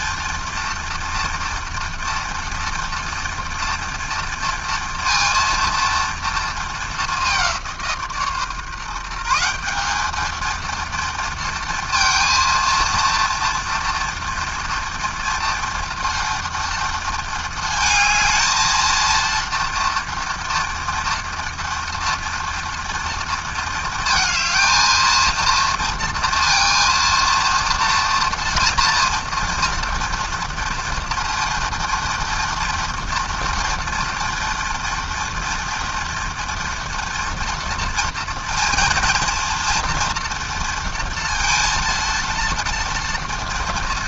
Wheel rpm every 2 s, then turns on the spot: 230, 230, 230, 190, 170, 230, 230, 230, 220, 230, 230, 230, 230, 230, 230, 230, 240, 240, 230, 230, 230, 230.
none